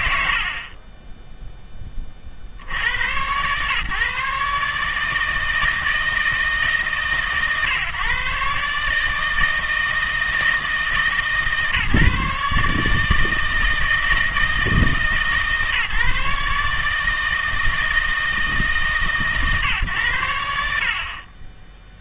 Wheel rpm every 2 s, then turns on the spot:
70, 80, 150, 150, 140, 160, 150, 150, 140, 150, 70.
none